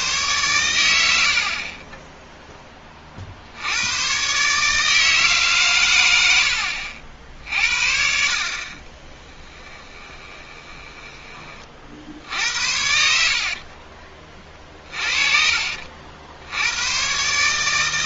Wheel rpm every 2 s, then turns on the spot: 100, 20, 150, 70, 30, 20, 60, 40, 100.
6-16